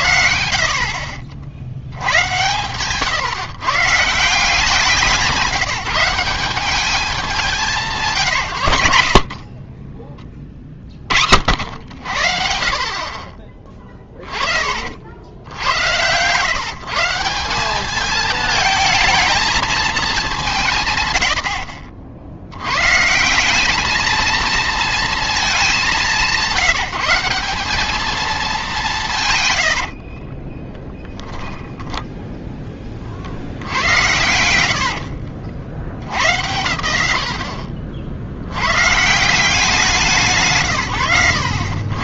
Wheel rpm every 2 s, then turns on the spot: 70, 110, 180, 180, 150, 30, 60, 40, 150, 220, 170, 110, 230, 180, 200, 10, 10, 90, 100, 60, 100.
30-32